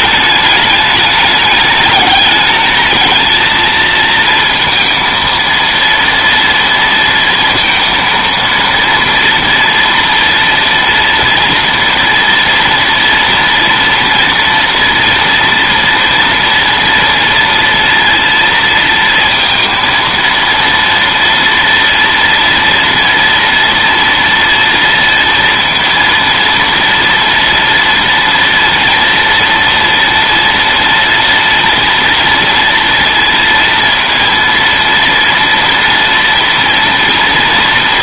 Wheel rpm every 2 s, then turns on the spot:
210, 210, 230, 230, 230, 230, 230, 230, 230, 230, 230, 230, 230, 230, 230, 230, 230, 230, 230.
none